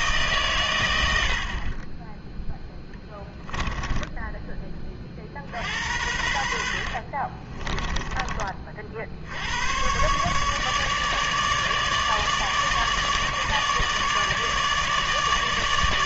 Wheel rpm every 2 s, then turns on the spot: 110, 10, 20, 70, 40, 150, 150, 150.
2-4 6-8